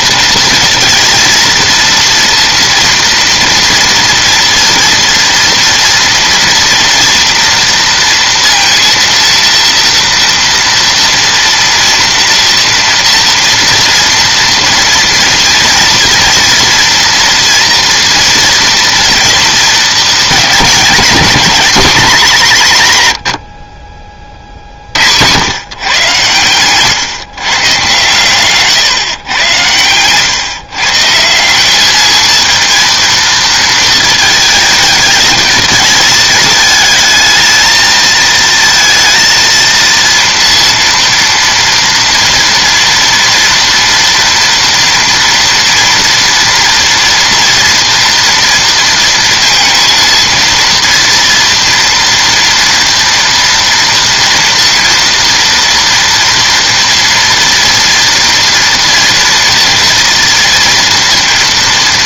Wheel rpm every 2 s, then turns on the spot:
230, 230, 230, 230, 230, 230, 230, 230, 230, 230, 210, 150, 70, 110, 130, 140, 230, 220, 220, 230, 230, 230, 230, 230, 230, 230, 230, 230, 240, 240, 230.
none